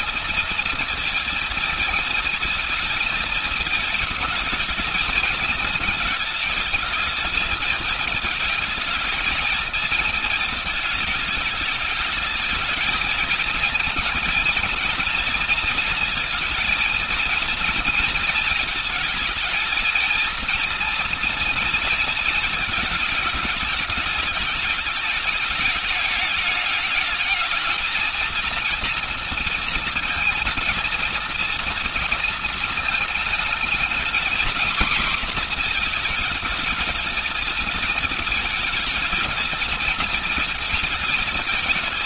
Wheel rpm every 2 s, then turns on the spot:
230, 220, 220, 220, 220, 220, 220, 230, 220, 220, 230, 230, 220, 210, 230, 230, 220, 240, 220, 220, 220.
none